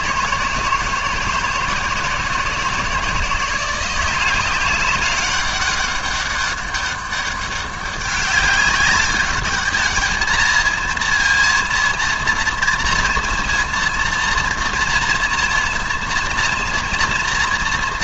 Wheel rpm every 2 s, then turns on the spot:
160, 170, 190, 200, 200, 220, 230, 230, 230.
none